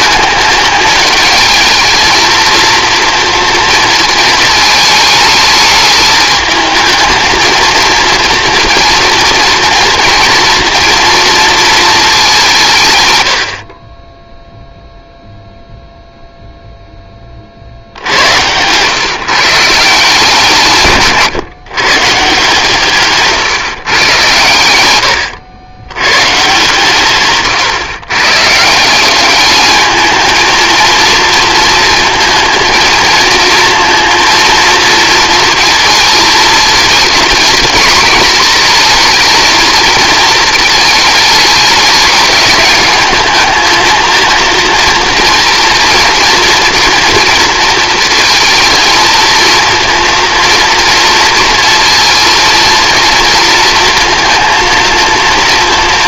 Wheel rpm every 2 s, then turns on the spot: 220, 230, 220, 220, 230, 230, 180, 0, 0, 90, 160, 150, 100, 130, 130, 220, 220, 230, 220, 230, 220, 210, 230, 230, 230, 230, 230, 230.
none